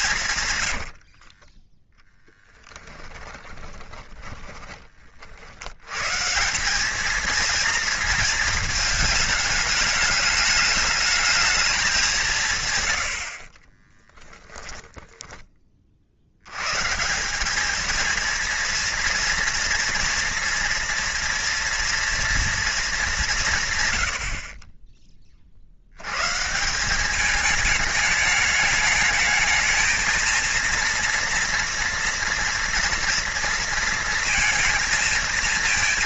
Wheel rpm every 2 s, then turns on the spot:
80, 20, 30, 200, 220, 210, 110, 20, 130, 230, 230, 210, 30, 180, 210, 230, 230, 230.
0-4 14-16